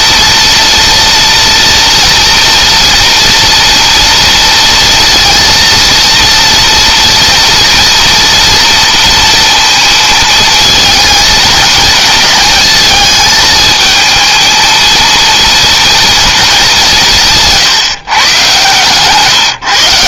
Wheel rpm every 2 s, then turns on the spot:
230, 230, 230, 230, 230, 230, 220, 230, 160, 140.
none